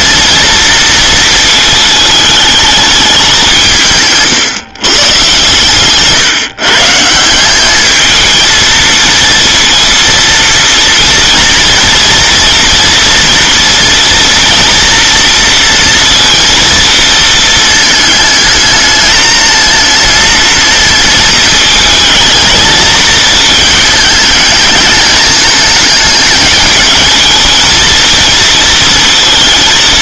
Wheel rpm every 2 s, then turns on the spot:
230, 210, 130, 140, 230, 230, 240, 230, 230, 220, 230, 230, 210, 210, 230.
none